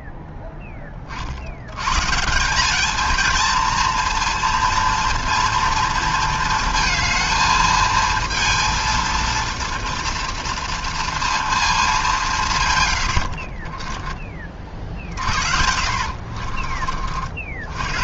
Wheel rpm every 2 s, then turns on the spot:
10, 200, 230, 220, 230, 230, 120, 40, 40.
none